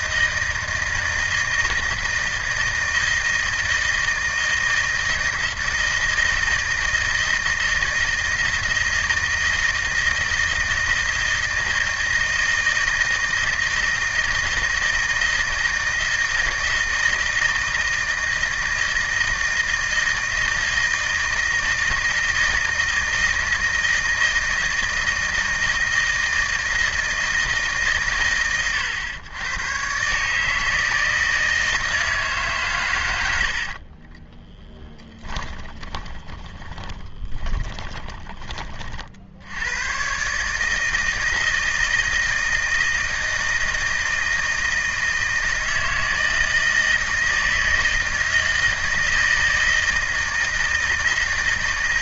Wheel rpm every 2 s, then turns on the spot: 160, 160, 160, 160, 160, 160, 160, 160, 160, 160, 160, 160, 160, 160, 110, 150, 140, 10, 20, 30, 150, 160, 160, 160, 160, 160.
34-38